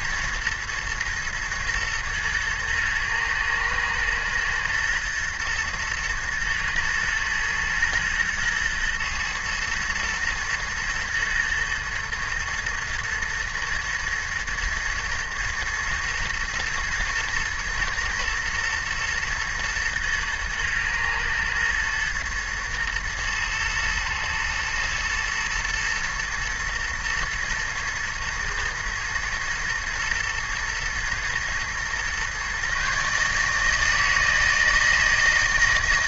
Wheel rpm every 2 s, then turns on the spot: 120, 110, 110, 110, 110, 120, 120, 120, 110, 110, 110, 120, 110, 120, 110, 110, 140, 160.
none